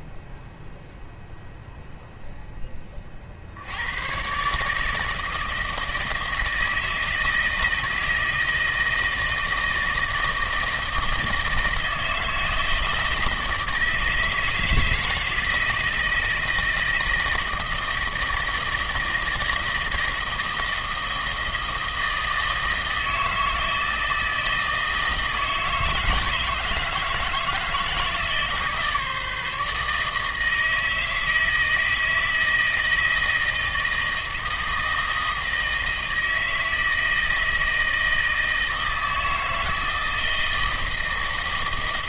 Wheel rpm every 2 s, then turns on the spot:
0, 20, 150, 160, 160, 160, 160, 160, 160, 160, 160, 160, 160, 160, 150, 160, 160, 160, 160, 160, 160.
none